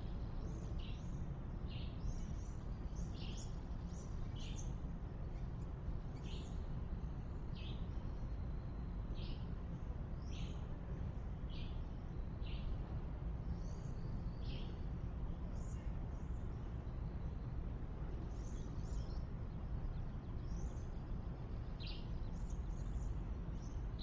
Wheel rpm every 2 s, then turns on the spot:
0, 0, 0, 0, 0, 0, 0, 0, 0, 0, 0, 0.
none